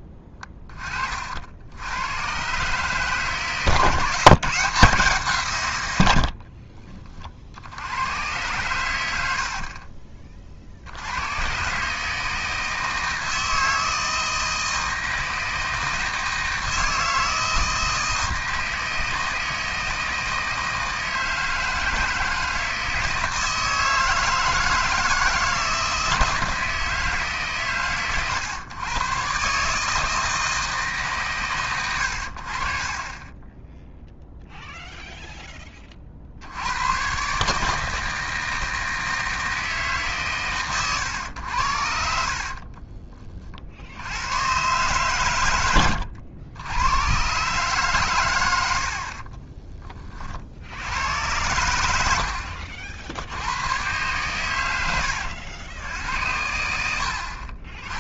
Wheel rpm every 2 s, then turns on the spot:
20, 130, 160, 50, 100, 50, 160, 160, 160, 160, 160, 160, 160, 160, 120, 160, 50, 0, 90, 160, 120, 50, 120, 90, 90, 60, 60, 110, 80.
6-8 42-44